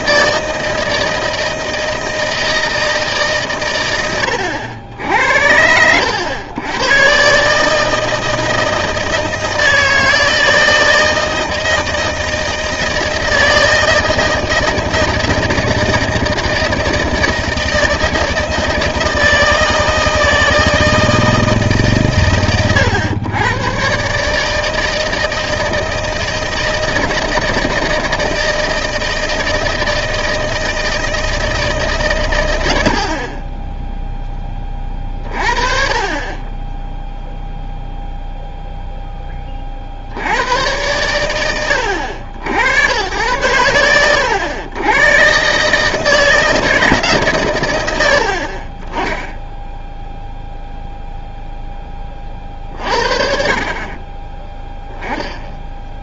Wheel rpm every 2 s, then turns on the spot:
160, 160, 90, 110, 160, 160, 160, 160, 160, 160, 160, 120, 160, 160, 160, 160, 90, 20, 10, 0, 100, 90, 100, 160, 20, 0, 40, 10.
none